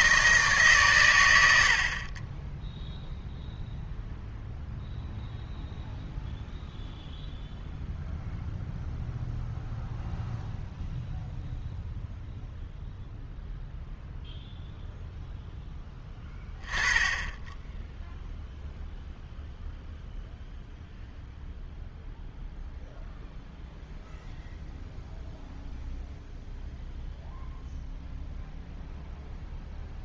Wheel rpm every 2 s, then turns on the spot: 140, 0, 0, 0, 0, 0, 0, 0, 10, 0, 0, 0, 0, 0, 0.
none